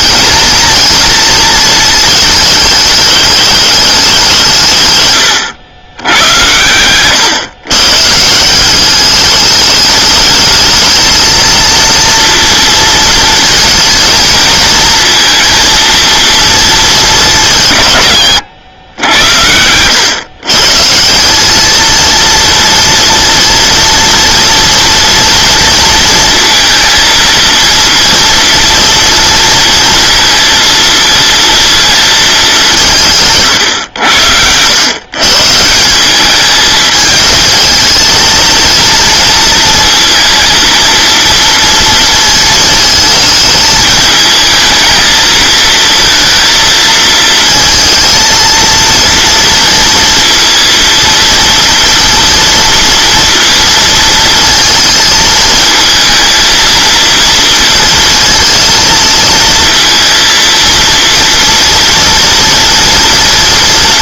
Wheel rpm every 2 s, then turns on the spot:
220, 210, 150, 100, 180, 220, 230, 230, 220, 100, 150, 230, 230, 230, 230, 230, 190, 100, 220, 230, 230, 220, 220, 220, 230, 230, 230, 230, 230, 230, 230, 230.
none